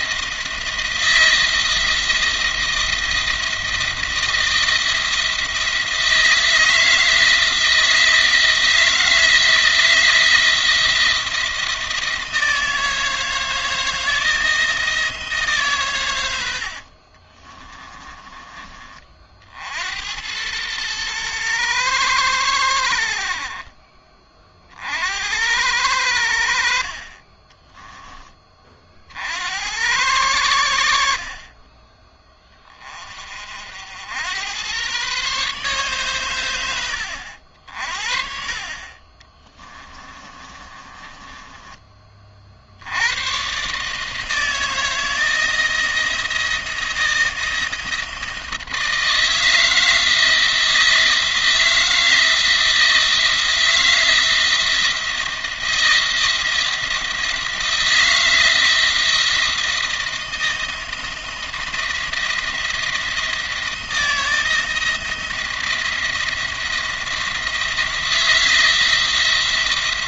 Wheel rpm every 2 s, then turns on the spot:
170, 170, 170, 160, 160, 170, 160, 160, 50, 40, 110, 70, 60, 50, 50, 70, 40, 120, 90, 30, 30, 90, 160, 160, 160, 160, 170, 170, 170, 160, 170, 170, 170, 170, 170.
16-18 38-42